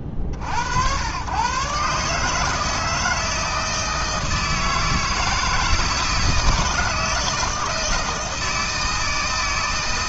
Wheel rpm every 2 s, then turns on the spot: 60, 160, 160, 160, 160.
none